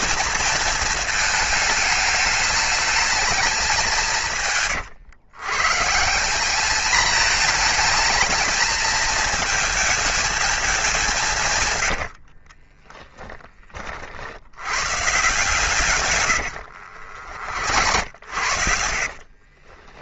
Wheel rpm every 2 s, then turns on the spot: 230, 220, 120, 210, 220, 210, 30, 120, 70, 60.
12-14 16-20